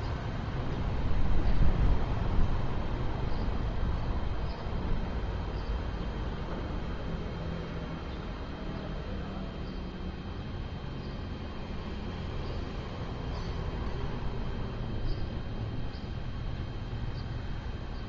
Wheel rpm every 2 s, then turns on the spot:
0, 0, 0, 0, 0, 0, 0, 0, 0.
none